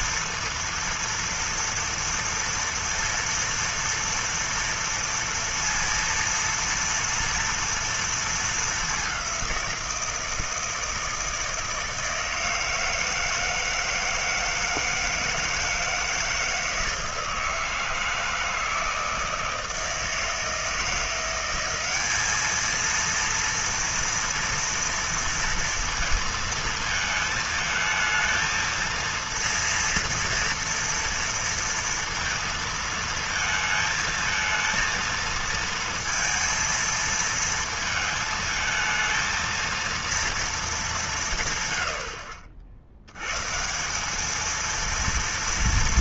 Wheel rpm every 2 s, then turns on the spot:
230, 230, 230, 230, 220, 170, 160, 160, 160, 160, 160, 210, 230, 230, 220, 230, 230, 220, 230, 220, 230, 70, 210.
none